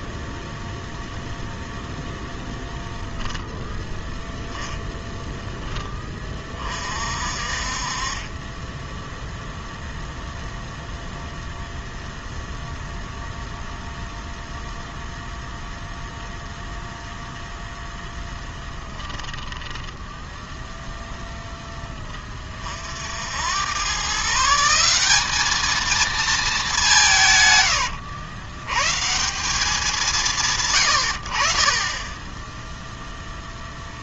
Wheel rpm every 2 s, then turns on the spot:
0, 0, 10, 40, 0, 0, 0, 0, 0, 20, 0, 60, 190, 160, 160, 100, 0.
18-20